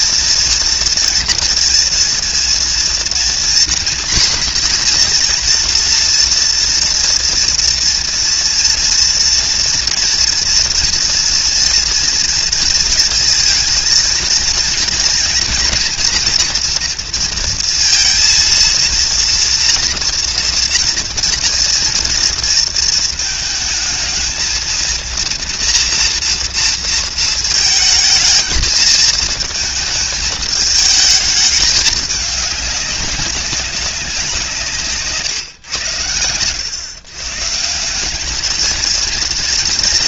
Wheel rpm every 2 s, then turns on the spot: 230, 230, 240, 230, 230, 230, 230, 230, 230, 230, 230, 230, 230, 230, 220, 210, 200, 160, 110, 220.
none